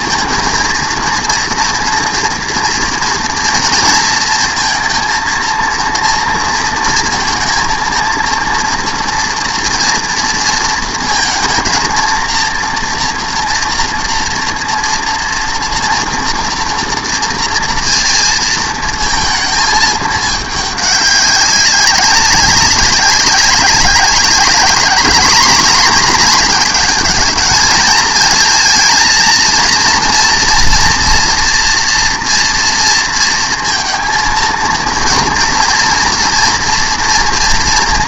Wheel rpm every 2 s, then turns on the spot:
230, 230, 220, 230, 230, 230, 230, 240, 240, 230, 210, 200, 210, 220, 230, 240, 230, 230, 230.
none